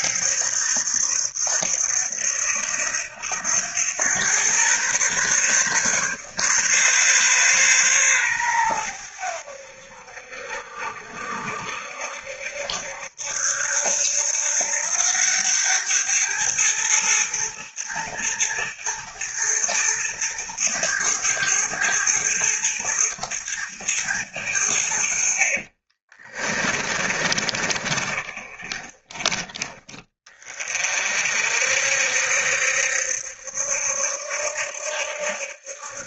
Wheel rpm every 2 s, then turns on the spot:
60, 80, 120, 140, 110, 70, 70, 90, 110, 110, 110, 110, 90, 30, 30, 40, 70, 70.
26-30